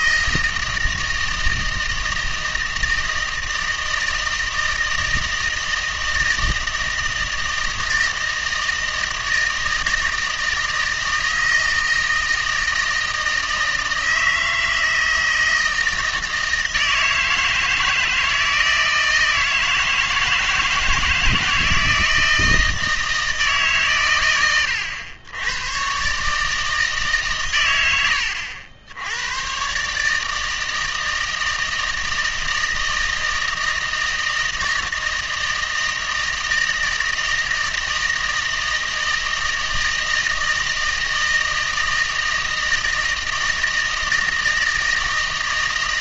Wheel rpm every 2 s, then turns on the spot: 160, 160, 160, 160, 160, 160, 160, 160, 160, 160, 160, 160, 100, 150, 80, 160, 160, 160, 160, 160, 160, 160, 160.
none